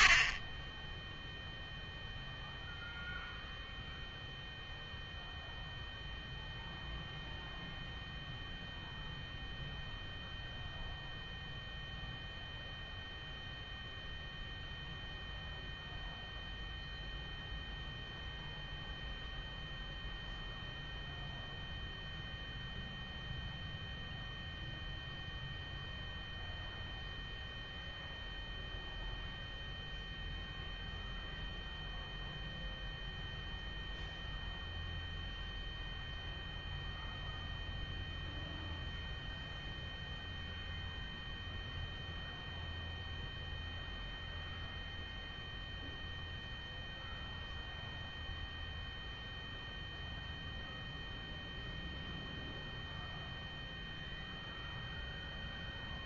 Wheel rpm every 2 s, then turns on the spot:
10, 0, 0, 0, 0, 0, 0, 0, 0, 0, 0, 0, 0, 0, 0, 0, 0, 0, 0, 0, 0, 0, 0, 0, 0, 0, 0, 0.
none